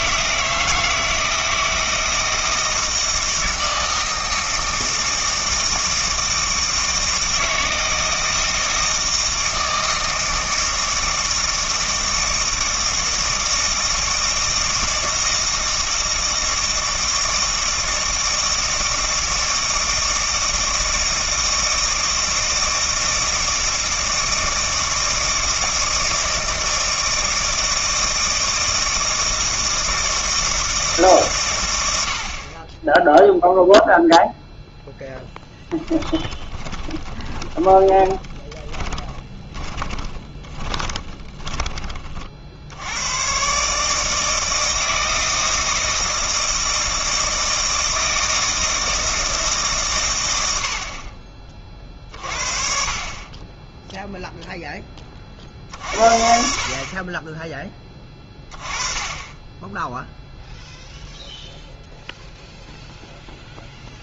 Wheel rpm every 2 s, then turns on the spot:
160, 160, 160, 160, 160, 160, 160, 160, 160, 160, 160, 160, 160, 160, 160, 150, 20, 0, 20, 20, 20, 80, 160, 160, 160, 80, 50, 10, 40, 20, 0, 0.
36-42